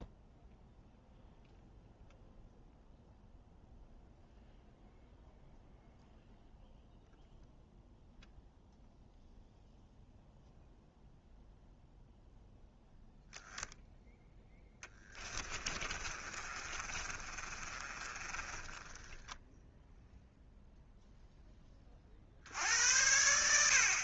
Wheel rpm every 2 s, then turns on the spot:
0, 0, 0, 0, 0, 0, 10, 10, 30, 20, 0, 70.
14-20